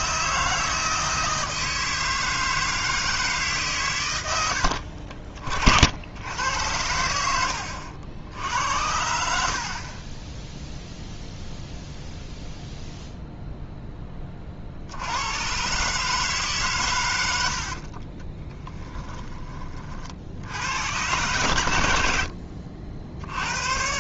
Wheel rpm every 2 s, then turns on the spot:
160, 160, 70, 90, 80, 0, 0, 50, 140, 10, 100, 60.
18-20